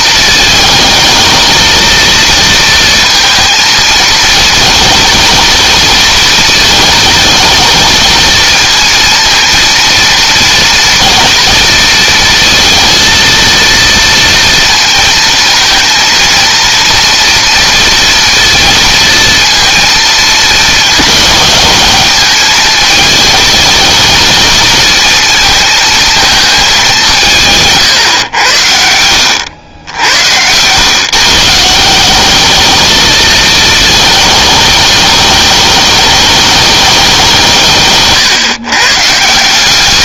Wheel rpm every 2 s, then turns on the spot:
220, 230, 220, 230, 230, 230, 230, 230, 230, 230, 210, 220, 230, 180, 80, 130, 220, 210, 200, 140.
none